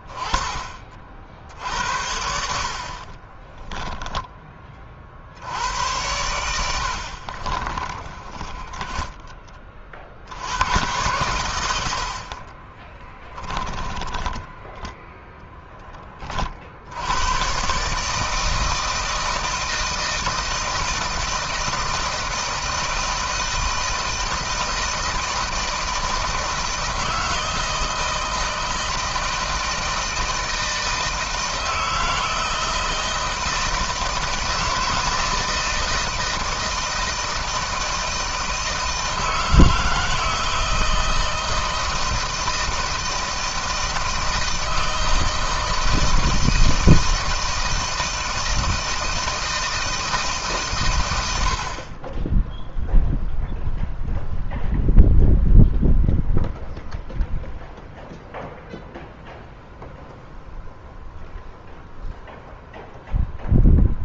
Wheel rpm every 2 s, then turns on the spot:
30, 70, 20, 80, 10, 100, 40, 10, 40, 160, 160, 160, 160, 160, 160, 160, 160, 160, 160, 160, 160, 160, 160, 160, 160, 140, 10, 0, 0, 0, 0, 0.
2-4 6-10 12-16